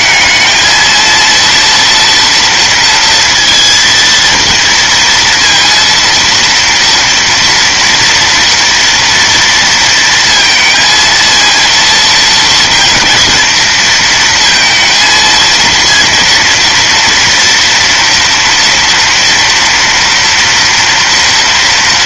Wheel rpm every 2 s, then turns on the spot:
220, 230, 230, 230, 230, 230, 230, 230, 230, 230, 240.
none